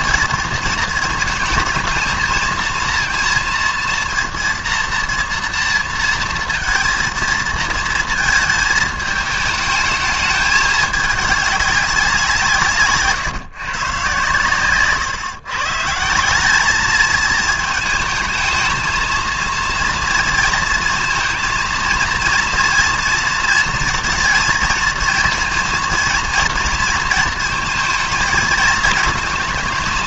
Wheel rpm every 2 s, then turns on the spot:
220, 230, 230, 230, 220, 210, 150, 140, 210, 220, 230, 230, 230, 230, 220.
14-16